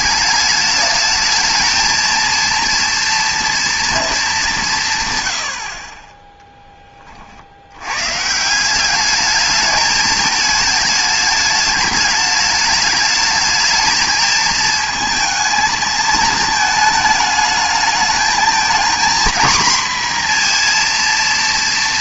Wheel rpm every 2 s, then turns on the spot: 210, 230, 170, 10, 180, 210, 210, 220, 220, 220, 240.
none